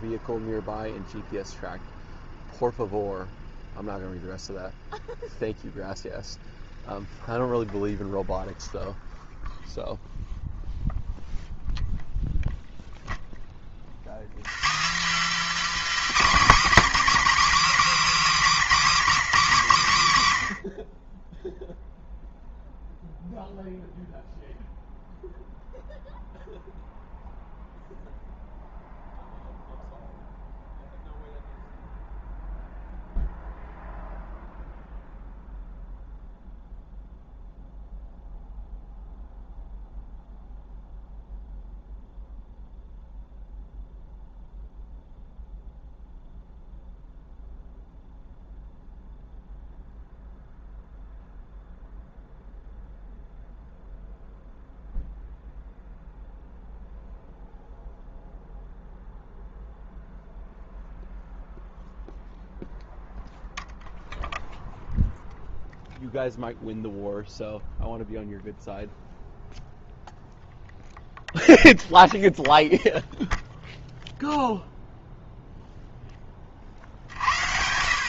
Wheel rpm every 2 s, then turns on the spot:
0, 0, 0, 0, 0, 0, 0, 230, 270, 260, 60, 0, 0, 0, 0, 0, 0, 0, 0, 0, 0, 0, 0, 0, 0, 0, 0, 0, 0, 0, 0, 0, 0, 0, 0, 0, 0, 0, 50.
none